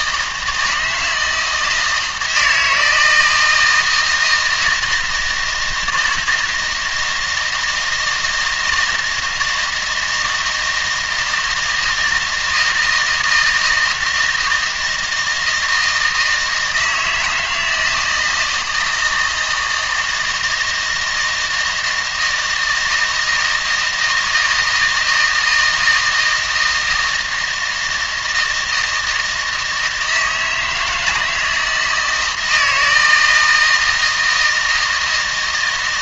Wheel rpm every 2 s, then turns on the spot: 160, 160, 160, 160, 160, 160, 160, 160, 160, 160, 160, 160, 160, 160, 160, 160, 160, 160.
none